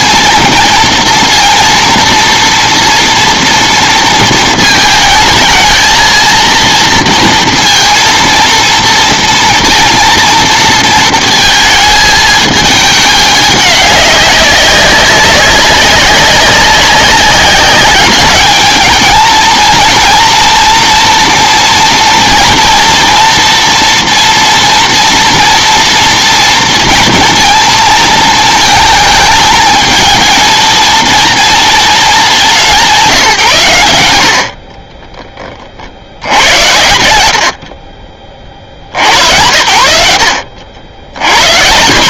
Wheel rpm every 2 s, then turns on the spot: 230, 230, 220, 230, 230, 230, 220, 200, 190, 210, 230, 230, 230, 230, 220, 220, 190, 60, 80, 70, 70.
none